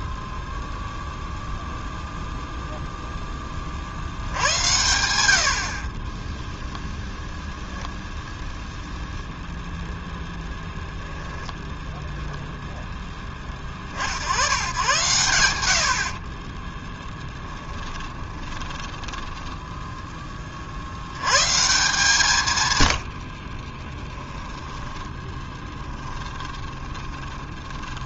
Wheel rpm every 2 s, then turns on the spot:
0, 0, 90, 0, 0, 0, 10, 110, 20, 10, 60, 100, 10, 20.
16-20 24-28